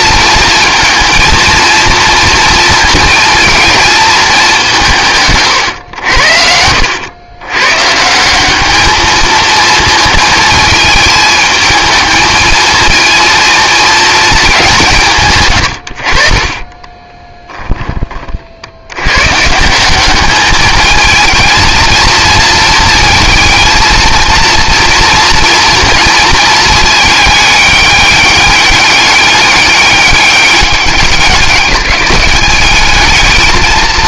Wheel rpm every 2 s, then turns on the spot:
230, 230, 180, 80, 200, 220, 220, 190, 20, 70, 220, 220, 230, 220, 200, 200, 210.
16-18